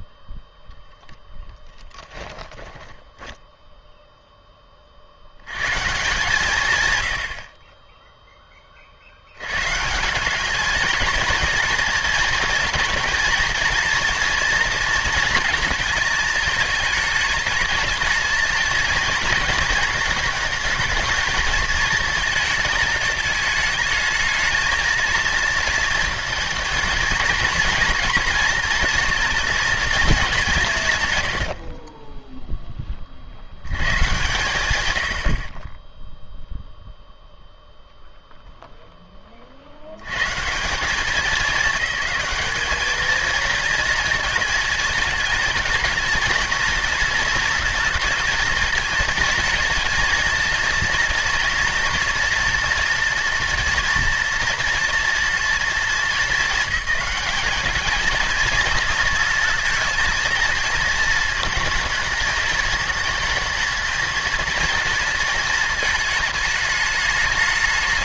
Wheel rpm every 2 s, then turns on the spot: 0, 10, 30, 130, 20, 210, 230, 230, 210, 220, 220, 220, 220, 220, 230, 140, 20, 100, 0, 10, 170, 220, 220, 230, 230, 230, 230, 230, 220, 220, 220, 220, 230, 210.
2-4